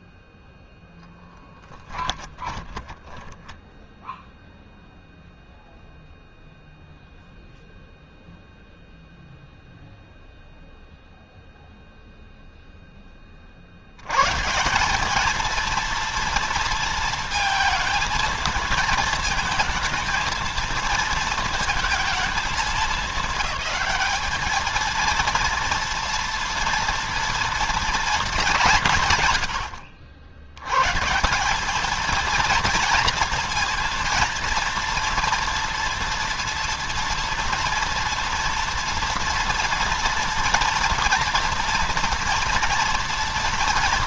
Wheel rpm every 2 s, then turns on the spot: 10, 10, 0, 0, 0, 0, 30, 210, 230, 230, 230, 210, 230, 230, 130, 150, 230, 230, 230, 230, 230, 230.
0-4